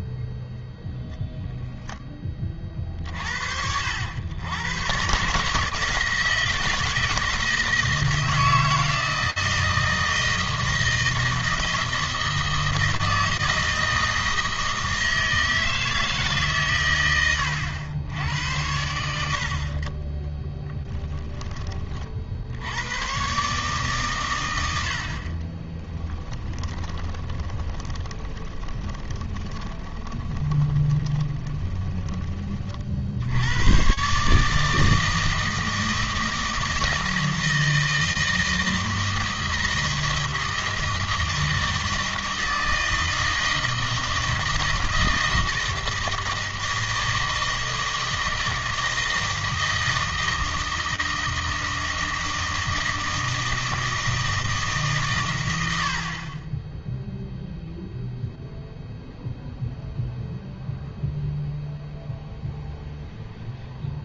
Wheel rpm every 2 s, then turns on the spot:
0, 40, 120, 160, 160, 160, 160, 160, 120, 90, 10, 100, 80, 20, 20, 20, 50, 160, 160, 160, 160, 160, 160, 160, 160, 160, 160, 150, 10, 0, 0, 0.
20-22 26-32